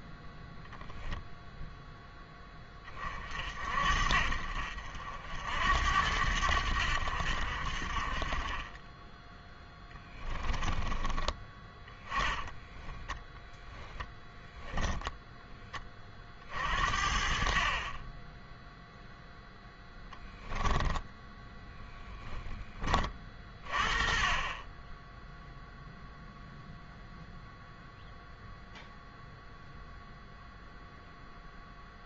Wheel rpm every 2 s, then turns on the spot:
0, 30, 60, 80, 20, 20, 10, 0, 50, 0, 10, 10, 20, 0, 0, 0.
10-14